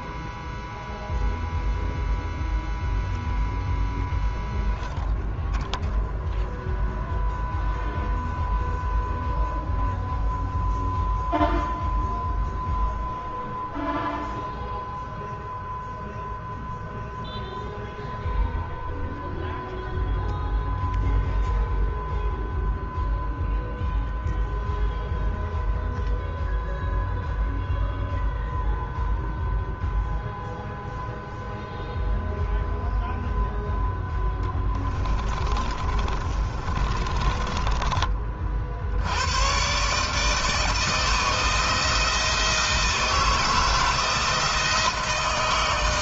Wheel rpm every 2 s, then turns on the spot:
0, 0, 0, 0, 0, 0, 0, 0, 0, 0, 0, 0, 0, 0, 0, 0, 0, 20, 30, 70, 160, 160, 160.
34-38